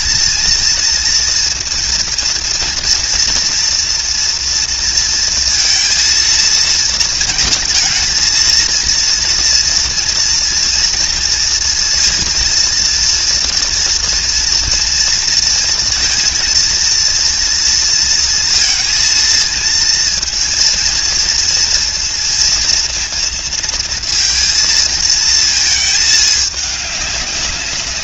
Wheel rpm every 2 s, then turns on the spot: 230, 230, 230, 230, 230, 230, 230, 230, 230, 230, 230, 230, 230, 210.
none